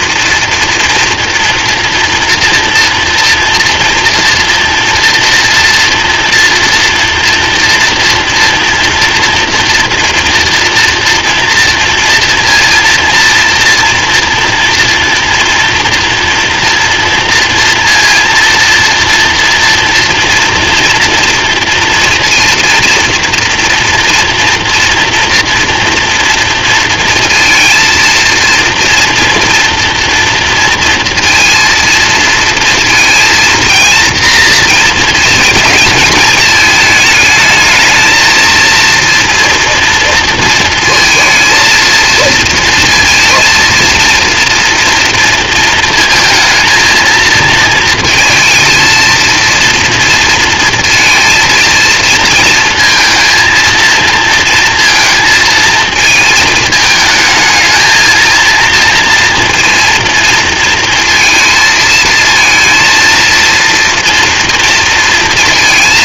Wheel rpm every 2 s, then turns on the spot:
230, 230, 230, 230, 230, 240, 230, 230, 240, 230, 230, 230, 240, 230, 230, 230, 230, 230, 220, 230, 220, 230, 230, 230, 230, 230, 230, 230, 220, 230, 230, 230, 230.
none